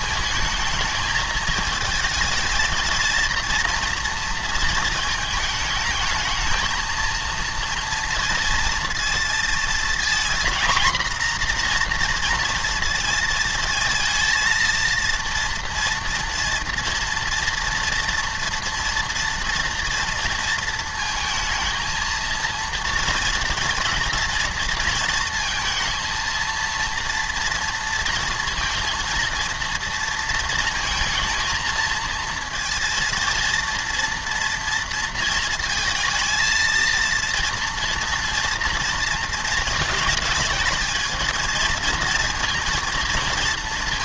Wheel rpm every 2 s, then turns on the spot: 220, 220, 230, 230, 230, 240, 230, 230, 230, 230, 230, 230, 230, 230, 230, 230, 230, 230, 230, 230, 220, 230.
none